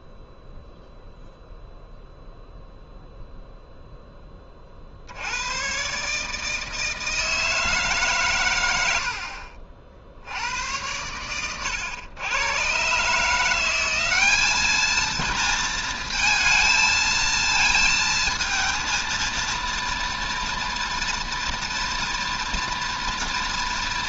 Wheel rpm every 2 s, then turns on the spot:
0, 0, 40, 160, 90, 90, 120, 220, 220, 220, 240, 230.
none